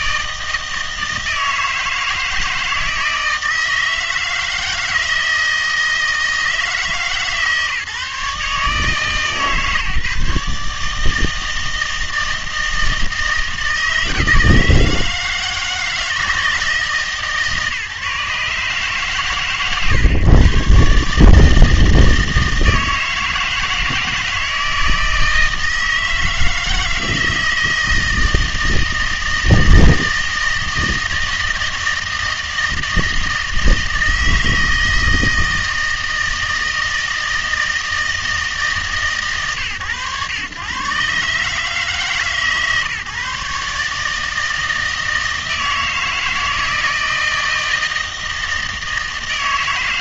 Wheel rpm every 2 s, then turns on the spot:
160, 160, 160, 160, 150, 150, 160, 160, 160, 140, 130, 160, 160, 160, 160, 160, 160, 160, 160, 160, 110, 140, 160, 160, 160.
none